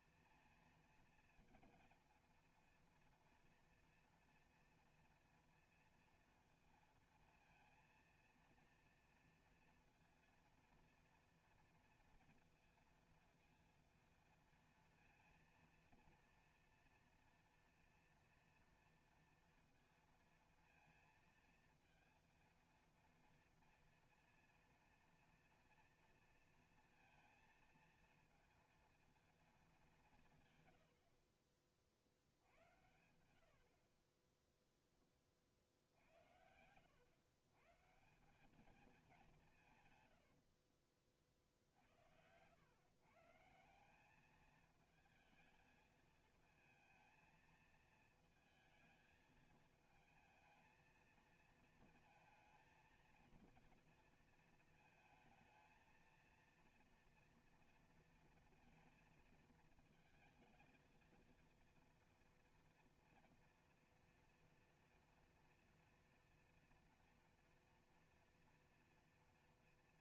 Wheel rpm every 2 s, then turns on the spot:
230, 230, 230, 230, 230, 240, 230, 230, 230, 230, 230, 230, 240, 230, 230, 190, 60, 30, 80, 170, 100, 80, 200, 220, 220, 220, 230, 230, 230, 230, 220, 230, 230, 230, 230.
40-42